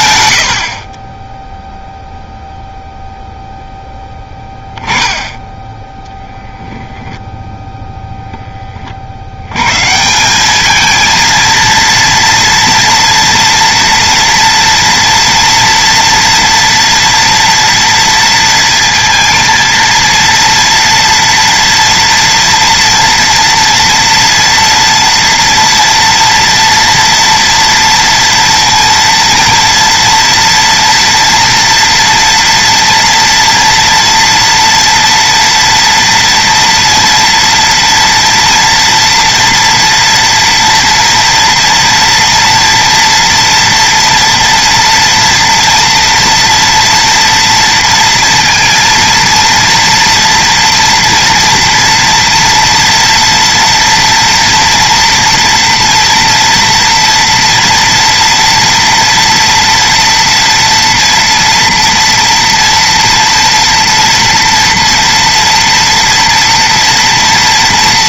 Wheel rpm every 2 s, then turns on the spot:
70, 0, 10, 0, 20, 210, 230, 240, 230, 230, 230, 230, 230, 240, 230, 230, 240, 230, 230, 230, 230, 230, 230, 230, 230, 230, 230, 240, 230, 230, 230, 240, 240, 230.
0-2